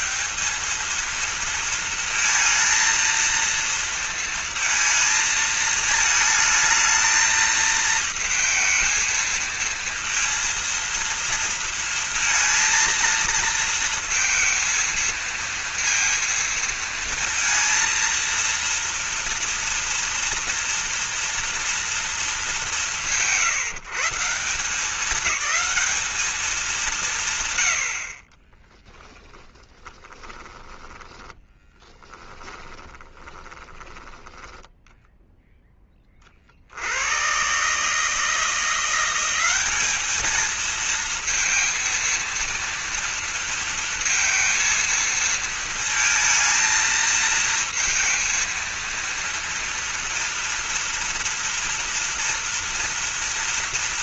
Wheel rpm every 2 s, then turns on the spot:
220, 230, 230, 220, 220, 230, 230, 230, 230, 230, 230, 140, 210, 170, 0, 20, 10, 0, 80, 170, 230, 230, 230, 220, 230, 240, 230.
30-34